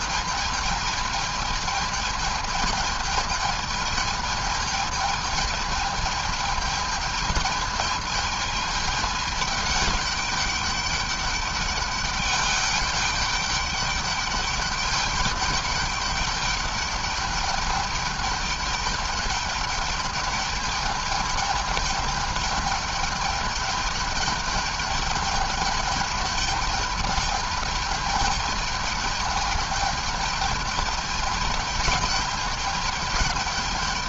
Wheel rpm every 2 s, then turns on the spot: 210, 220, 210, 210, 220, 200, 200, 200, 200, 210, 210, 210, 210, 210, 210, 210, 210.
none